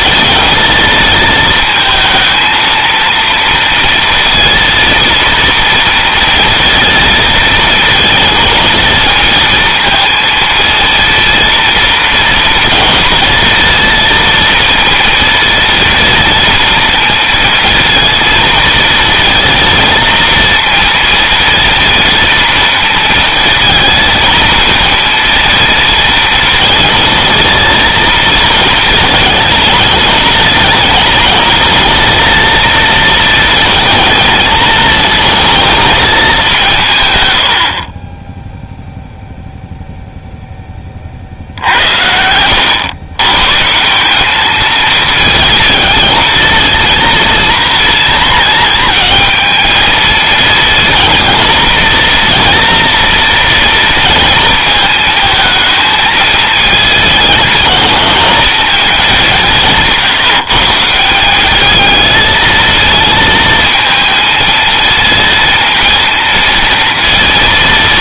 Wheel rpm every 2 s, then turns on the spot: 230, 230, 230, 230, 230, 230, 230, 230, 230, 230, 230, 230, 230, 230, 230, 220, 230, 220, 140, 0, 20, 110, 220, 230, 220, 230, 240, 230, 220, 210, 160, 220, 230, 230.
none